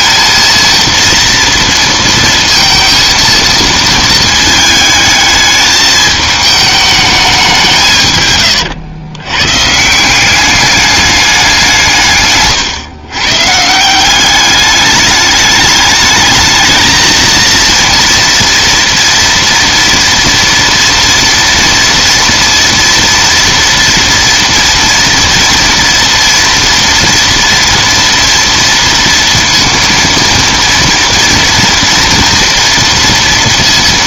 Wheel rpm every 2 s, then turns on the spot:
230, 230, 220, 210, 130, 200, 140, 200, 220, 230, 230, 230, 230, 230, 230, 230, 230.
8-10